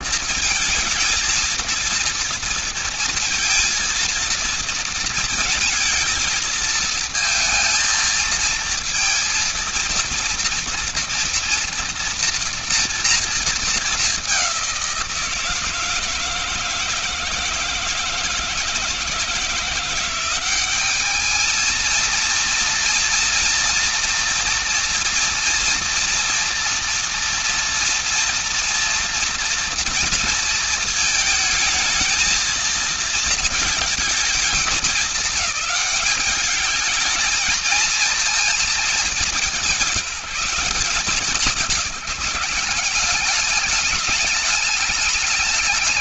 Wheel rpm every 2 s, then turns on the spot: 230, 230, 230, 220, 230, 230, 230, 180, 160, 160, 190, 230, 230, 230, 230, 230, 230, 210, 220, 220, 190, 190, 200.
none